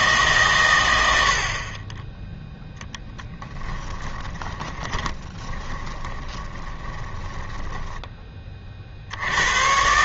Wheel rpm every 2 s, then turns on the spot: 120, 10, 20, 20, 40.
4-8